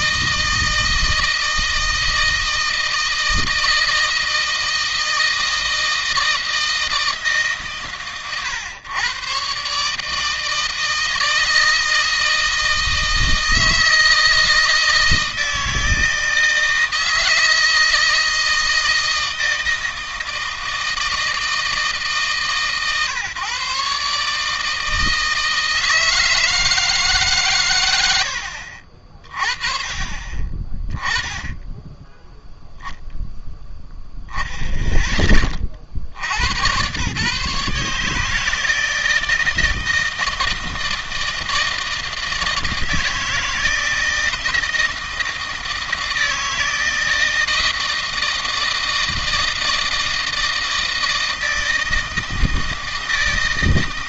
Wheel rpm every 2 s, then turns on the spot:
160, 160, 160, 160, 110, 160, 160, 160, 160, 160, 160, 150, 150, 160, 70, 30, 0, 0, 100, 150, 160, 160, 160, 160, 160, 160, 160.
none